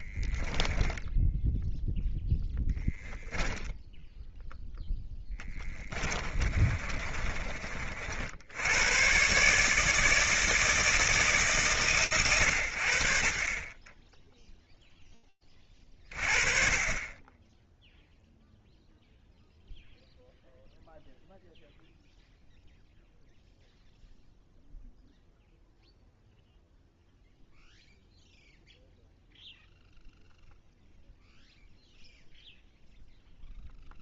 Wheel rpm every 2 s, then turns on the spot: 10, 0, 0, 30, 70, 160, 120, 10, 40, 0, 0, 0, 0, 0, 0, 0, 0.
6-8